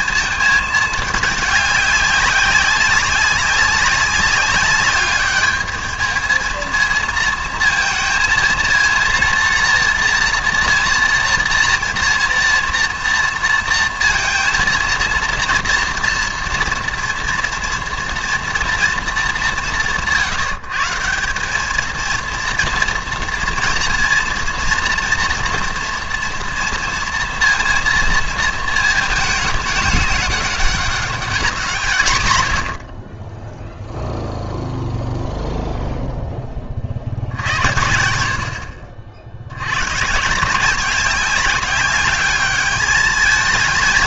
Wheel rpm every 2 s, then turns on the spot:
220, 200, 200, 220, 230, 240, 240, 230, 230, 240, 160, 230, 240, 240, 230, 200, 90, 0, 30, 60, 170, 210.
none